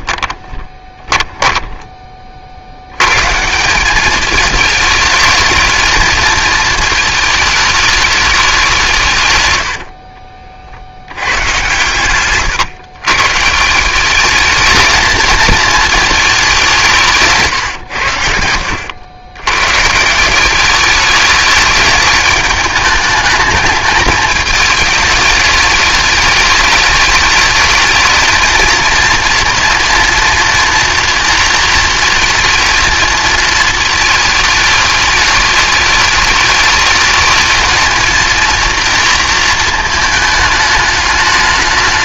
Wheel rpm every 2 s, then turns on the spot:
20, 100, 220, 220, 170, 70, 130, 220, 180, 80, 200, 210, 210, 210, 230, 230, 230, 210, 210, 230, 210.
0-2